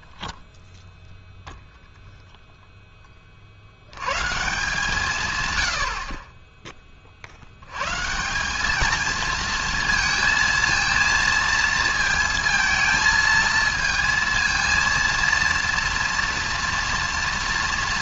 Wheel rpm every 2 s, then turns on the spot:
0, 0, 160, 20, 200, 230, 230, 230, 230.
none